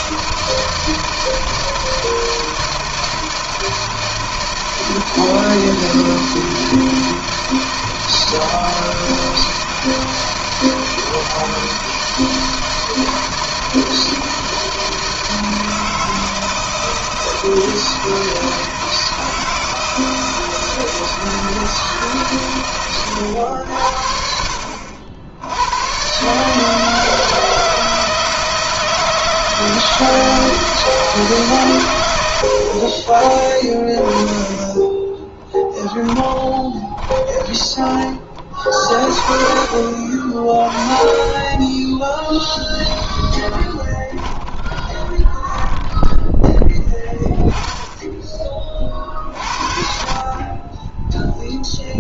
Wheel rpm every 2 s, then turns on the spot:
160, 160, 160, 160, 160, 160, 160, 160, 160, 160, 160, 110, 70, 160, 160, 160, 50, 20, 20, 30, 20, 10, 10, 10, 40, 10.
34-38 42-46